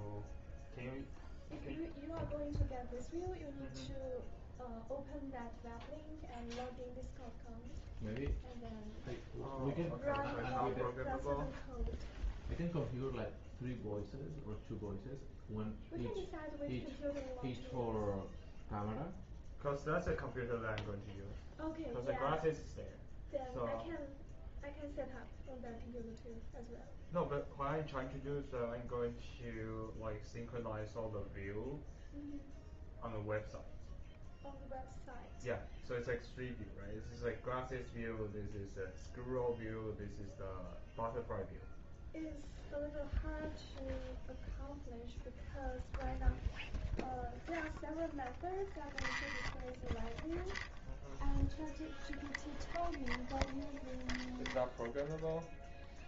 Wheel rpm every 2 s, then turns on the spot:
0, 0, 0, 0, 0, 0, 0, 0, 0, 0, 0, 0, 0, 0, 0, 0, 0, 0, 0, 0, 0, 0, 0, 0, 0, 0, 0, 0.
none